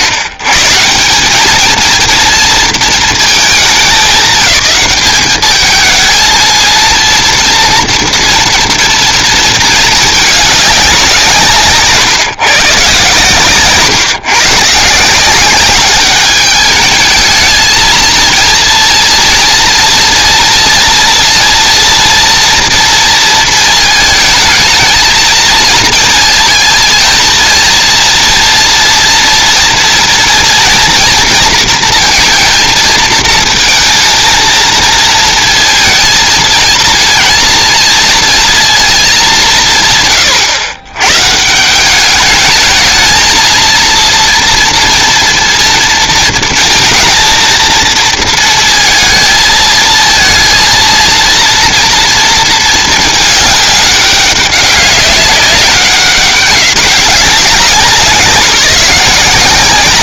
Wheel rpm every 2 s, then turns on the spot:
110, 230, 200, 230, 230, 200, 150, 140, 210, 230, 230, 230, 220, 220, 230, 230, 230, 220, 220, 230, 100, 210, 230, 220, 230, 230, 220, 200, 200, 180.
none